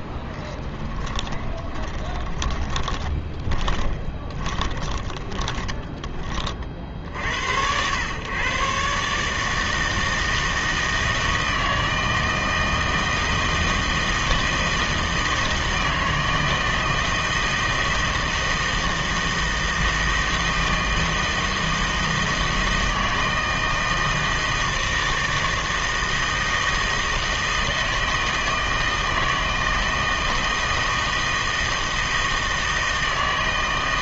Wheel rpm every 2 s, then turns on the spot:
10, 20, 10, 40, 130, 160, 160, 160, 160, 160, 160, 160, 160, 160, 160, 160, 160.
0-6